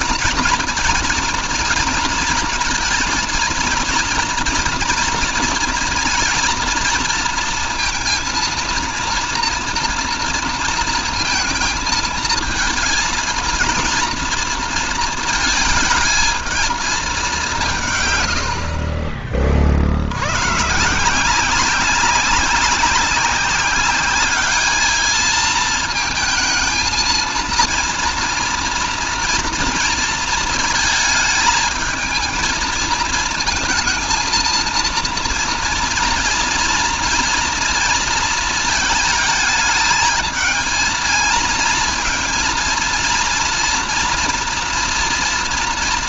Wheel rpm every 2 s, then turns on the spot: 240, 230, 230, 230, 240, 230, 230, 230, 200, 30, 170, 190, 220, 230, 230, 220, 220, 230, 230, 220, 230, 230, 230.
none